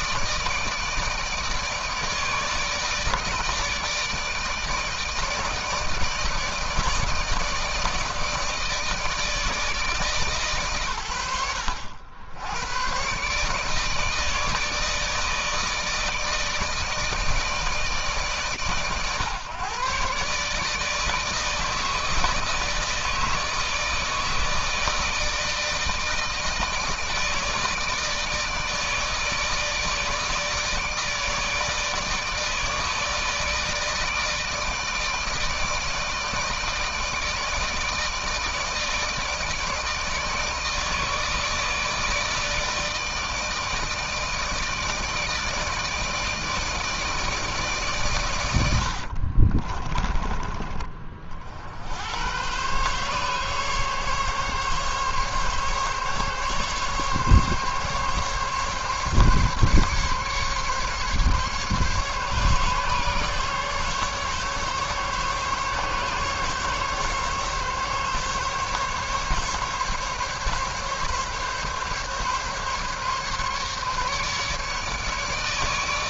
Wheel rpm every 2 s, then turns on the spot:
160, 150, 160, 160, 160, 130, 110, 160, 160, 130, 150, 160, 160, 160, 160, 160, 160, 160, 160, 160, 160, 160, 160, 160, 80, 30, 120, 140, 140, 140, 140, 140, 140, 140, 140, 140, 140, 150.
48-50